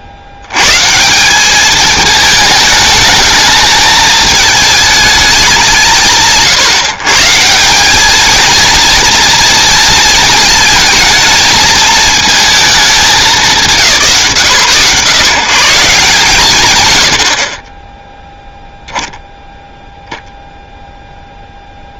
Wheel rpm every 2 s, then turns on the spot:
50, 220, 210, 120, 230, 220, 220, 120, 120, 0, 0.
none